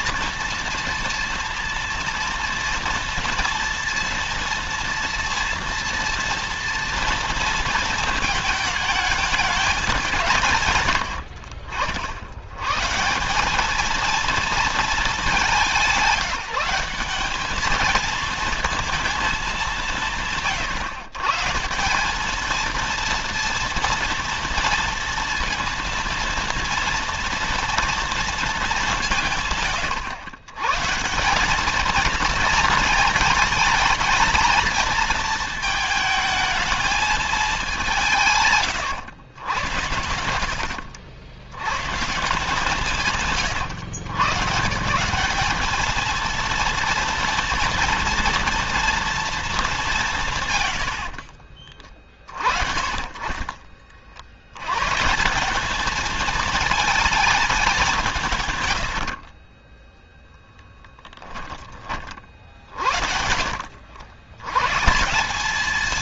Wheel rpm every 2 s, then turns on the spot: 230, 230, 230, 230, 210, 90, 140, 220, 190, 230, 130, 230, 230, 230, 170, 150, 220, 230, 220, 110, 100, 150, 160, 230, 230, 90, 40, 140, 220, 90, 10, 50, 160.
58-60